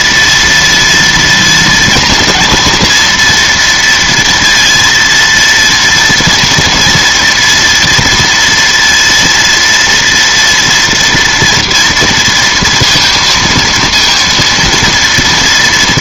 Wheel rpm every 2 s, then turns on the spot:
230, 240, 230, 230, 230, 230, 230, 230.
none